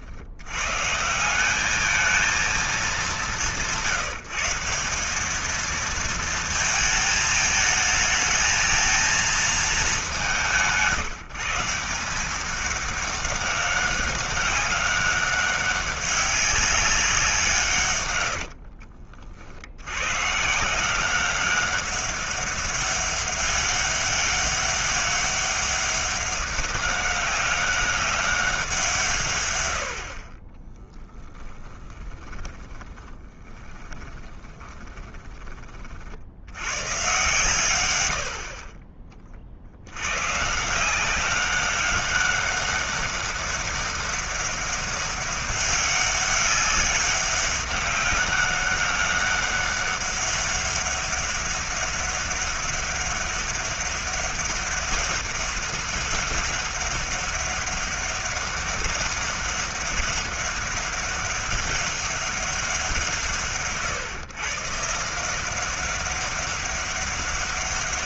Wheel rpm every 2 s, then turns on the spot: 140, 210, 180, 220, 220, 170, 200, 200, 200, 70, 170, 200, 200, 200, 180, 20, 10, 20, 110, 40, 170, 200, 200, 200, 200, 200, 200, 200, 200, 200, 200, 160, 140, 200.
18-20 30-36